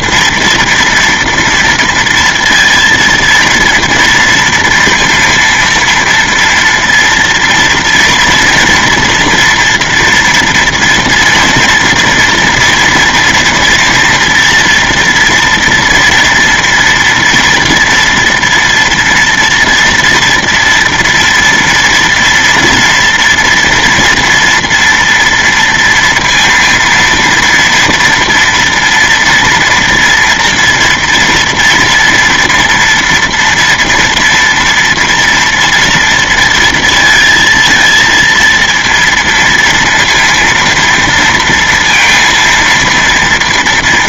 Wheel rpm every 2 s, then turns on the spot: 240, 230, 230, 230, 230, 230, 230, 240, 230, 240, 230, 230, 230, 230, 230, 230, 230, 240, 230, 230, 230, 230.
none